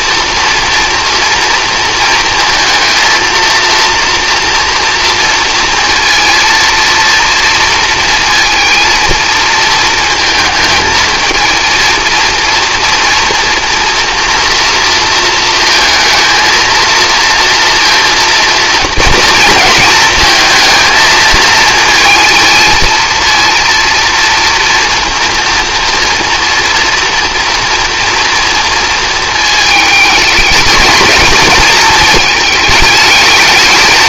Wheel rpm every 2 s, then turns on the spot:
230, 220, 240, 230, 230, 220, 230, 230, 220, 230, 220, 230, 230, 230, 230, 220, 210.
none